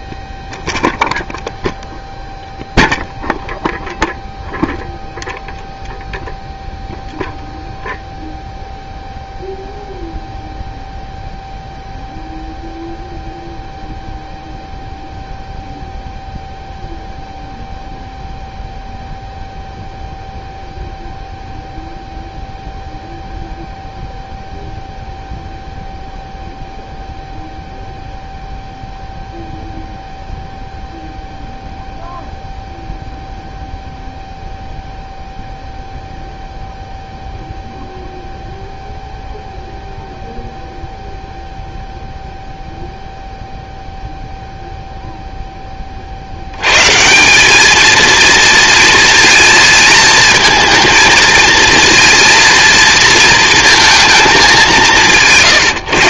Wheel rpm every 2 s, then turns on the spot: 0, 0, 0, 0, 0, 0, 0, 0, 0, 0, 0, 0, 0, 0, 0, 0, 0, 0, 0, 0, 0, 0, 0, 160, 230, 230, 230, 170.
54-56